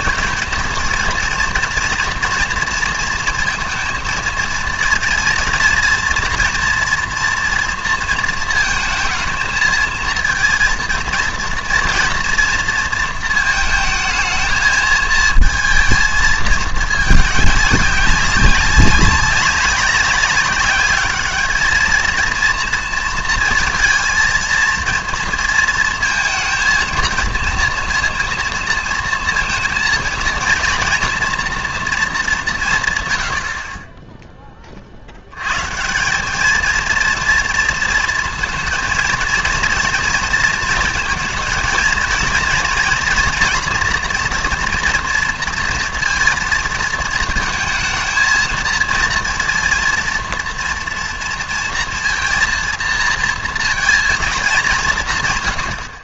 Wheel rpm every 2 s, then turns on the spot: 230, 230, 230, 230, 230, 230, 230, 220, 220, 190, 200, 230, 220, 230, 230, 230, 170, 30, 220, 230, 230, 230, 240, 230, 220, 230, 230, 190.
none